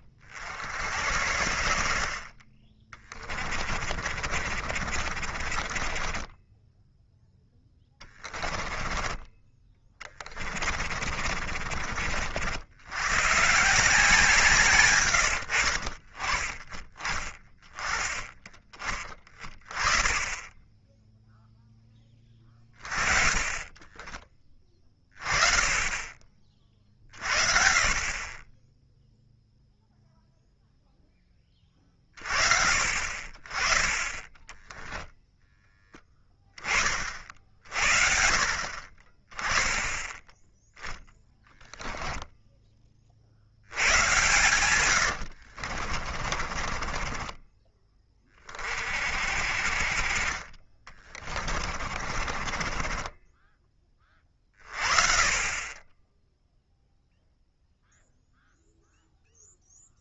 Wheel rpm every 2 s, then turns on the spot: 70, 30, 40, 10, 10, 40, 90, 140, 20, 20, 10, 20, 20, 40, 10, 0, 40, 0, 20, 40, 0, 20, 90, 30, 40, 30, 30, 30, 0, 0.
4-12 46-48 50-54